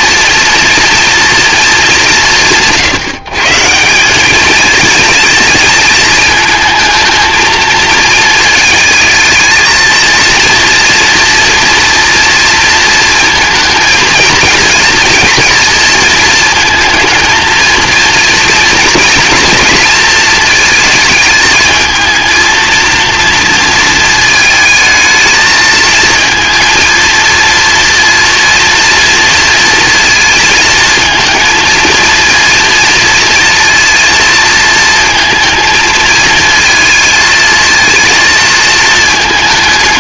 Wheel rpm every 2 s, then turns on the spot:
240, 150, 220, 220, 220, 230, 230, 230, 230, 230, 220, 230, 220, 230, 240, 230, 230, 230, 220, 220.
none